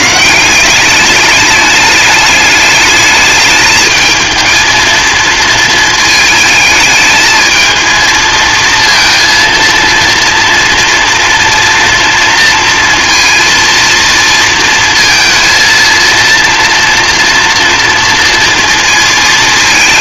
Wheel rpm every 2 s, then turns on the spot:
180, 210, 230, 220, 220, 230, 230, 230, 230, 230.
none